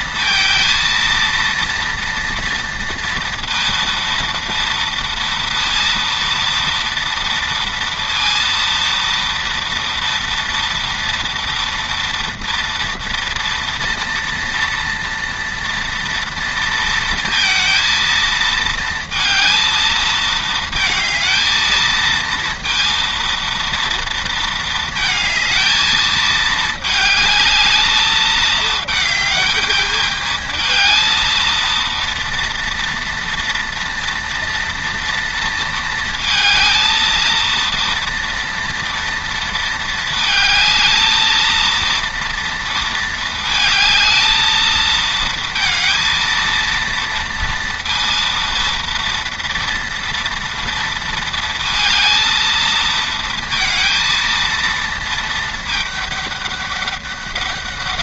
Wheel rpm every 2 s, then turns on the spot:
230, 230, 230, 230, 230, 230, 230, 230, 230, 230, 220, 230, 230, 220, 220, 220, 230, 230, 220, 230, 220, 230, 220, 230, 230, 230, 220, 230, 200.
none